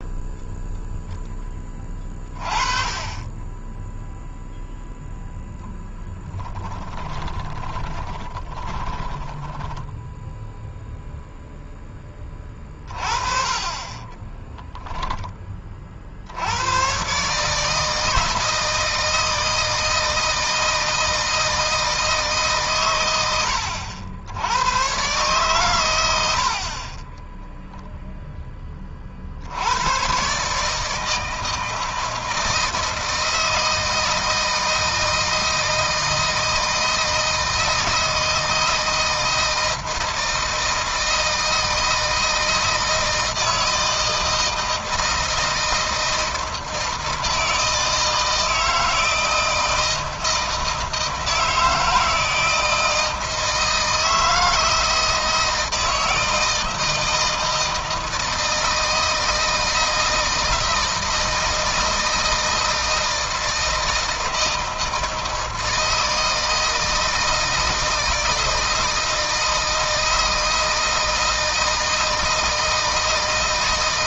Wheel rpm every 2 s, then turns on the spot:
0, 30, 0, 10, 10, 0, 30, 10, 100, 160, 160, 130, 110, 40, 20, 150, 160, 160, 160, 160, 160, 160, 160, 160, 160, 160, 160, 160, 160, 160, 160, 160, 160, 160, 160, 160, 160.
6-10 14-16